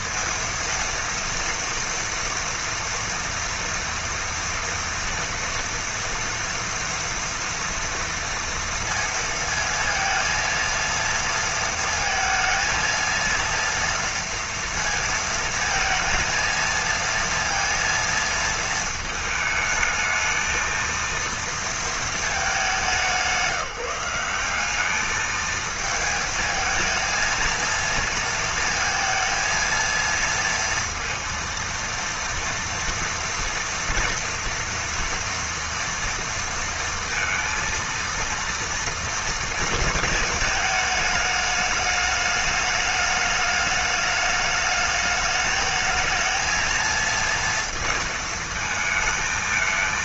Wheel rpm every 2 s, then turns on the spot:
230, 230, 230, 230, 230, 230, 230, 230, 230, 220, 220, 190, 200, 220, 230, 230, 240, 230, 230, 230, 220, 210, 210, 220, 220.
none